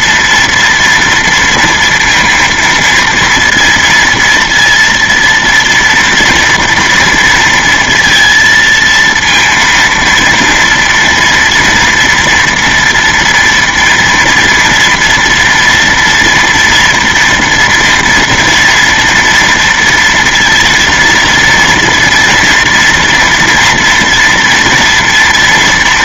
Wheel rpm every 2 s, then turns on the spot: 240, 230, 230, 230, 230, 230, 230, 240, 230, 230, 230, 230, 230.
none